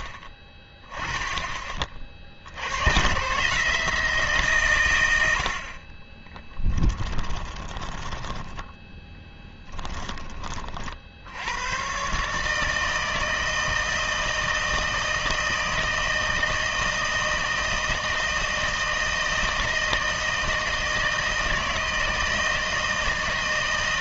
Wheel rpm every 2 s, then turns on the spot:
20, 80, 130, 10, 10, 40, 150, 160, 160, 160, 160, 160.
6-10